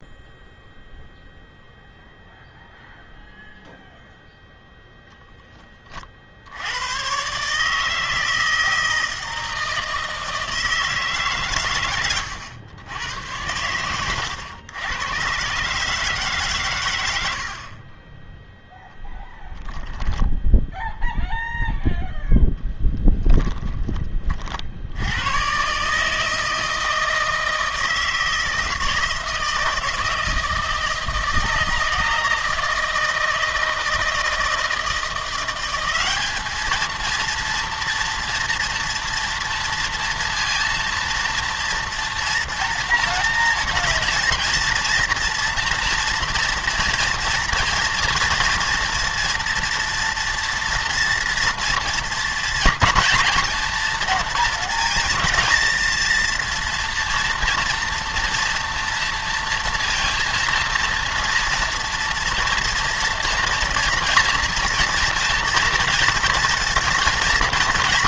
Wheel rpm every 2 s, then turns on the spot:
0, 0, 10, 140, 160, 120, 100, 130, 70, 10, 0, 10, 130, 160, 160, 160, 160, 180, 230, 230, 230, 240, 230, 230, 230, 230, 230, 220, 230, 230, 230, 230, 230, 230.
none